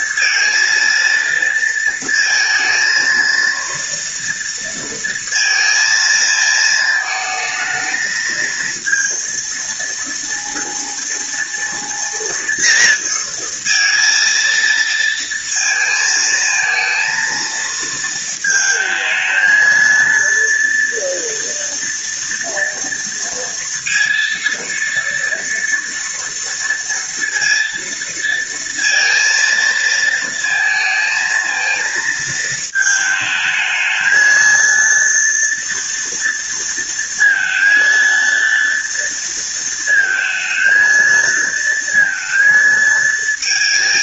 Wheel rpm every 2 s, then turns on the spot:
230, 230, 230, 220, 230, 230, 230, 230, 230, 220, 230, 230, 230, 230, 230, 230, 220, 230, 230, 230, 230, 220.
none